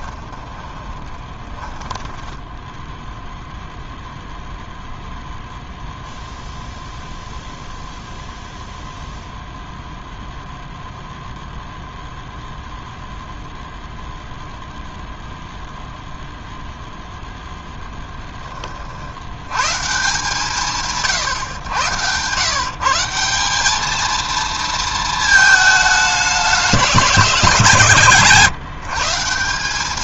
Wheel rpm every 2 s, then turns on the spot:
20, 10, 0, 0, 0, 0, 0, 0, 0, 40, 140, 150, 230, 210, 160.
0-4